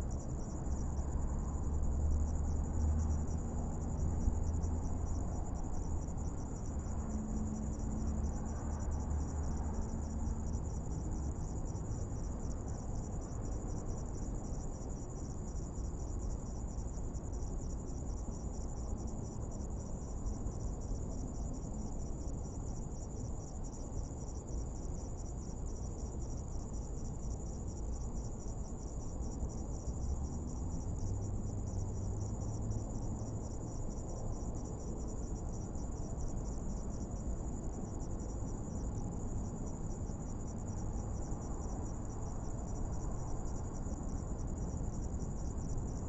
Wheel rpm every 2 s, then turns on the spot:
0, 0, 0, 0, 0, 0, 0, 0, 0, 0, 0, 0, 0, 0, 0, 0, 0, 0, 0, 0, 0, 0, 0.
none